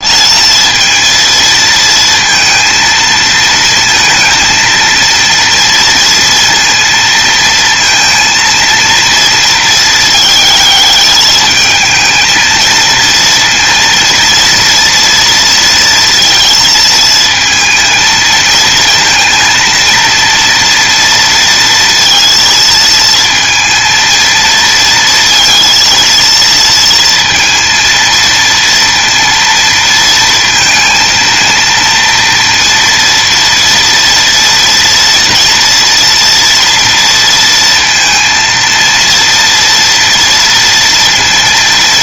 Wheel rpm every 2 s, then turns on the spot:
230, 230, 230, 230, 230, 210, 230, 230, 230, 230, 230, 230, 230, 230, 230, 230, 230, 230, 230, 230, 230.
none